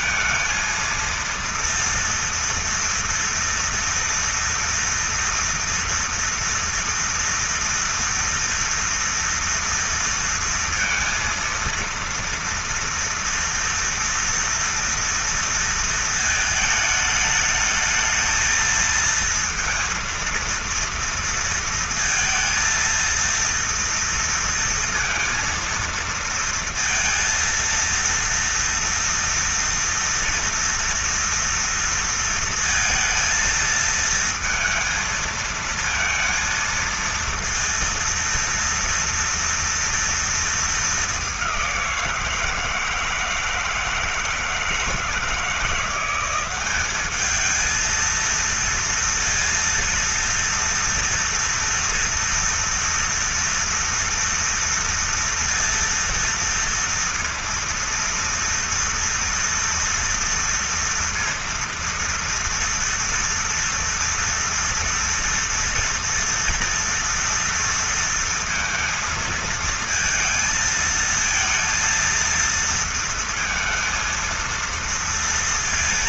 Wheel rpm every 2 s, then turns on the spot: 230, 230, 230, 230, 230, 230, 230, 230, 220, 220, 230, 230, 230, 230, 230, 230, 230, 230, 230, 230, 210, 160, 160, 200, 230, 240, 230, 230, 230, 230, 230, 230, 230, 230, 230, 230, 230, 230.
none